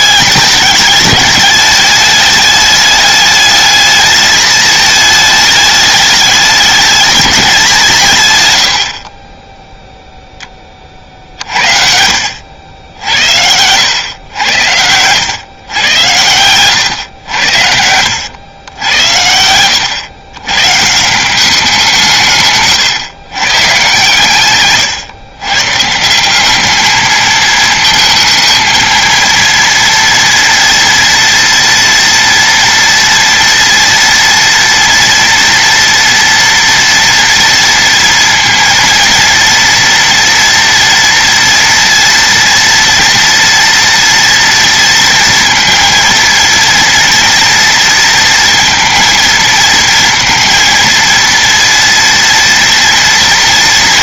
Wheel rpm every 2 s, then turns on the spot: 210, 210, 220, 210, 70, 40, 70, 90, 110, 110, 140, 140, 130, 210, 220, 230, 240, 230, 230, 230, 230, 230, 230, 230, 230, 230, 230.
16-18